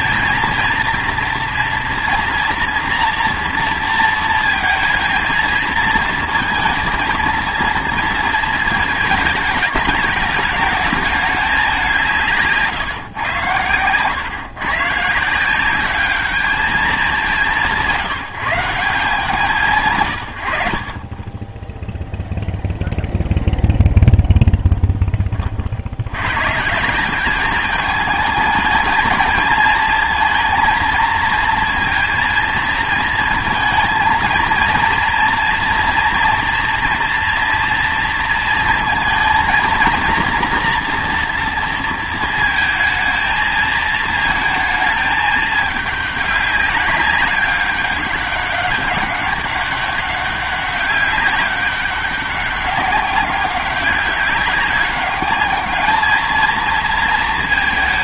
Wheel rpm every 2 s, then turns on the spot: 230, 230, 220, 230, 220, 210, 150, 130, 210, 170, 70, 0, 0, 150, 220, 230, 230, 230, 230, 230, 240, 230, 220, 200, 200, 200, 200, 200, 230.
none